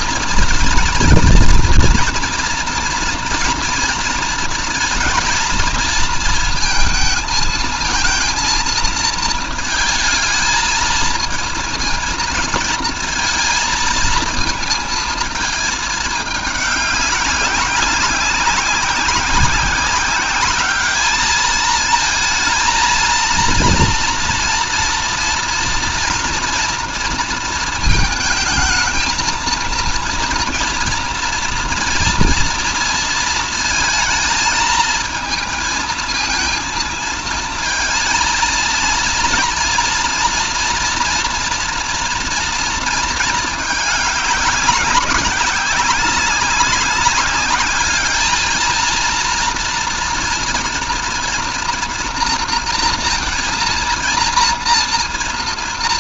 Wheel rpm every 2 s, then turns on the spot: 230, 230, 230, 230, 220, 230, 230, 220, 190, 190, 210, 230, 230, 230, 220, 230, 230, 220, 230, 230, 230, 220, 200, 200, 230, 230, 230, 230.
none